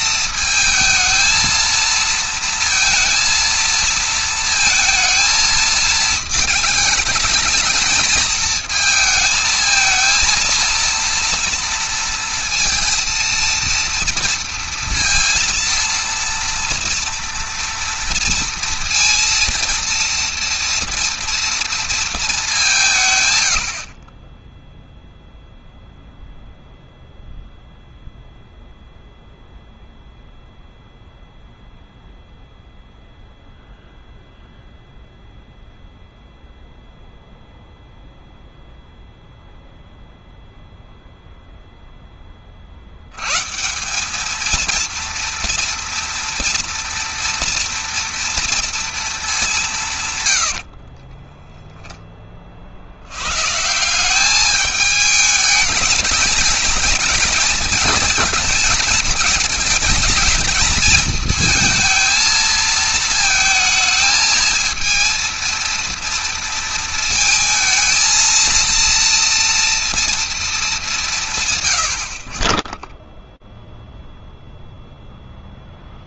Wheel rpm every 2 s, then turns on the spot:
230, 230, 220, 220, 220, 230, 230, 230, 230, 230, 230, 140, 0, 0, 0, 0, 0, 0, 0, 0, 0, 120, 230, 230, 200, 10, 100, 210, 220, 220, 220, 220, 230, 220, 230, 180, 0, 0.
50-52